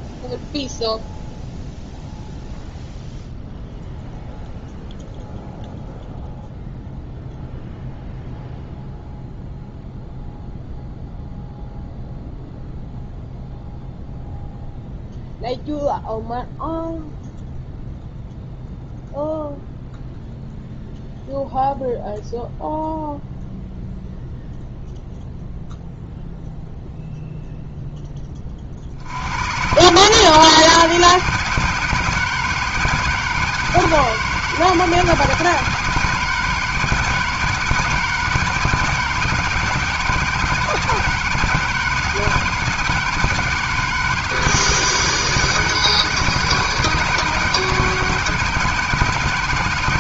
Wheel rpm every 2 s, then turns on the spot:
0, 0, 0, 0, 0, 0, 0, 0, 0, 0, 0, 0, 0, 0, 60, 160, 160, 160, 160, 160, 160, 160, 160, 160, 160.
none